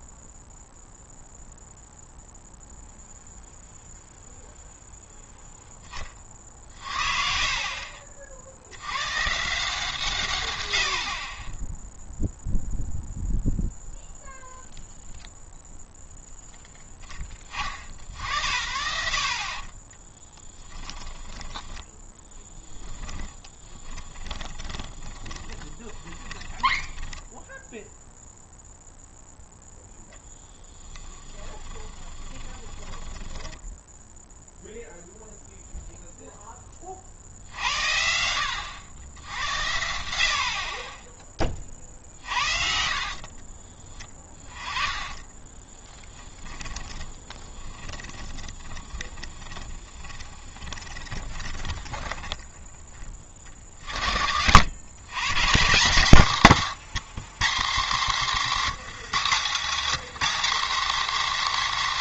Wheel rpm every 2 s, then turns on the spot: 0, 0, 0, 40, 80, 90, 0, 0, 0, 60, 10, 10, 20, 10, 0, 10, 20, 0, 30, 90, 30, 50, 20, 20, 20, 20, 20, 100, 160, 210, 260.
20-28 30-34 42-52